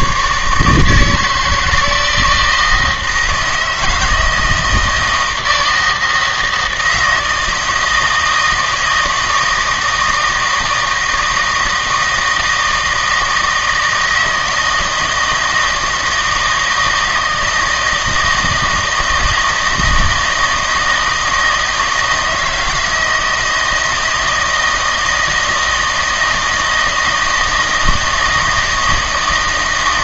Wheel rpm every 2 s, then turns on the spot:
150, 160, 160, 160, 160, 160, 160, 160, 160, 160, 160, 160, 160, 160, 160.
none